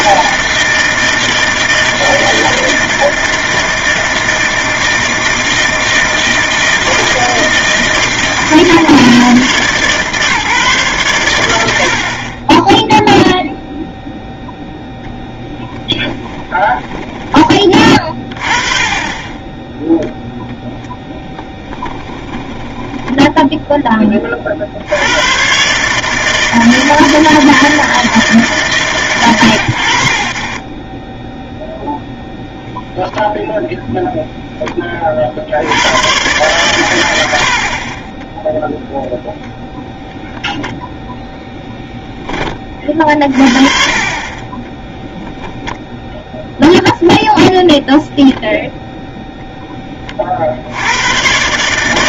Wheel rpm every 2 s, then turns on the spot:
160, 160, 160, 160, 150, 140, 10, 0, 10, 30, 0, 10, 80, 160, 130, 20, 0, 20, 110, 10, 0, 30, 20, 0, 0, 70.
16-18 22-24 44-46